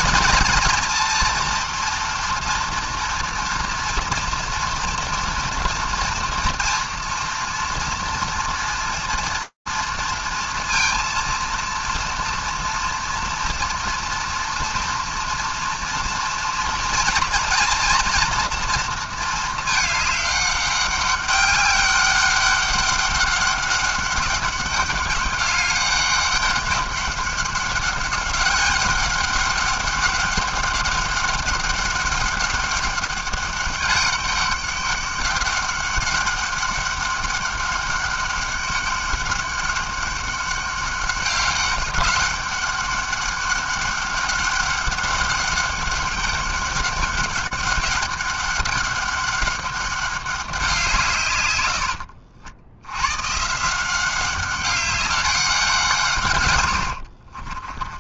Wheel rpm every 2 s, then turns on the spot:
230, 230, 230, 230, 230, 230, 230, 230, 230, 230, 200, 200, 200, 200, 200, 200, 200, 200, 200, 200, 200, 200, 200, 200, 200, 190, 70, 200, 110.
none